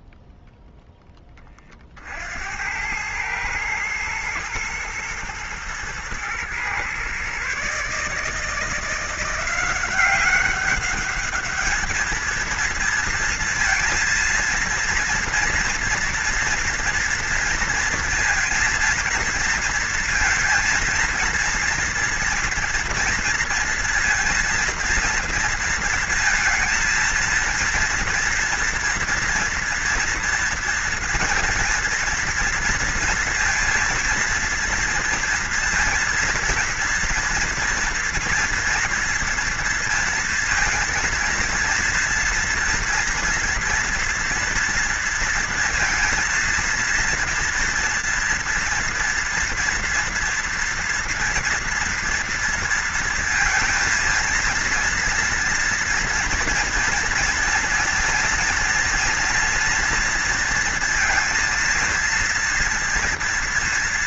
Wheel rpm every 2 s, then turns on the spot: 0, 80, 110, 120, 160, 200, 230, 230, 230, 230, 230, 240, 230, 230, 230, 230, 230, 230, 230, 230, 230, 230, 230, 230, 230, 230, 230, 230, 240, 240, 230, 230.
none